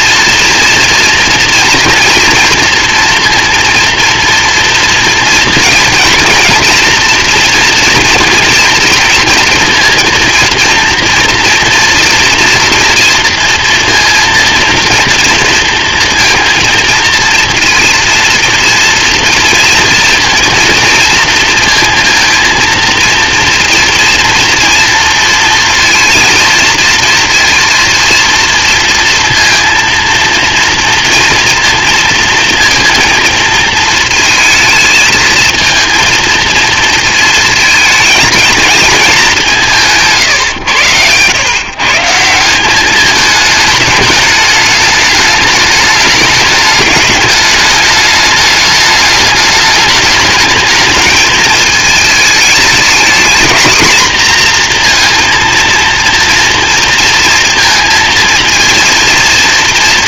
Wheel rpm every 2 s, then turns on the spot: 230, 230, 230, 230, 230, 230, 240, 230, 230, 230, 230, 230, 230, 230, 230, 230, 240, 220, 230, 230, 110, 200, 220, 210, 210, 210, 220, 240, 230, 230.
none